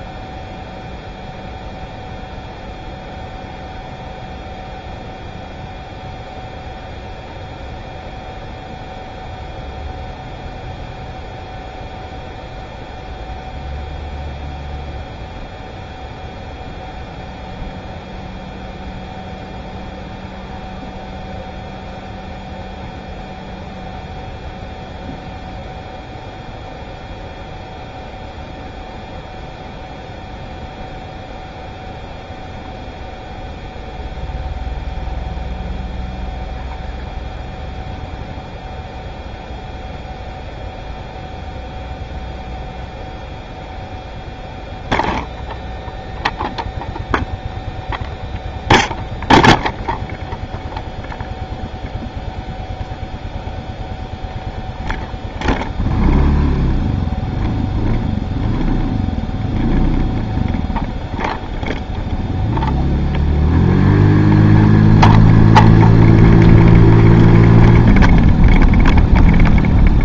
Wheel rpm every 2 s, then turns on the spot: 0, 0, 0, 0, 0, 0, 0, 0, 0, 0, 0, 0, 0, 0, 0, 0, 0, 0, 0, 0, 0, 0, 0, 0, 0, 0, 0, 0, 0, 0, 0, 0, 0, 0, 0.
none